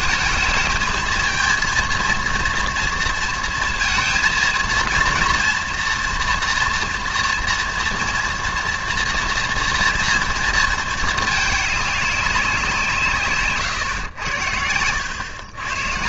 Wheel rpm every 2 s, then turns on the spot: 220, 230, 230, 240, 240, 230, 170, 90.
none